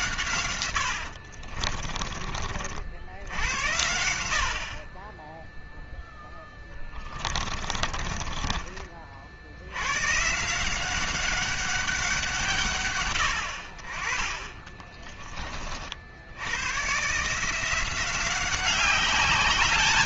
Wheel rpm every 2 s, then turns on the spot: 80, 60, 40, 20, 40, 180, 120, 20, 130, 190.
0-2 6-8